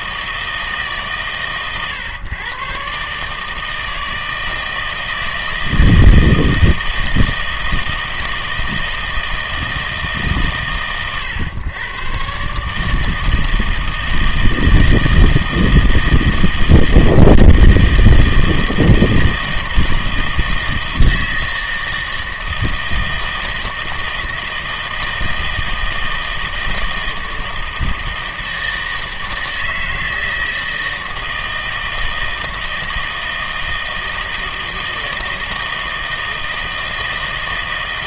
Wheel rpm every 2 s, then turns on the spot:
150, 130, 160, 160, 160, 120, 150, 160, 160, 160, 160, 160, 160, 160, 160, 160, 160, 160, 160.
none